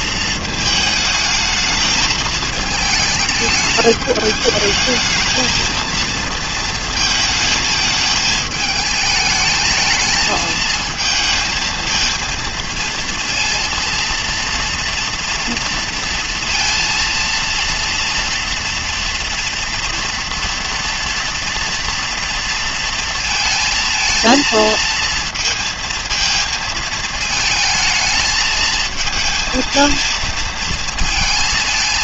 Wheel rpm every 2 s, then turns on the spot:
220, 220, 210, 220, 220, 220, 230, 230, 230, 230, 230, 230, 230, 220, 220, 230.
none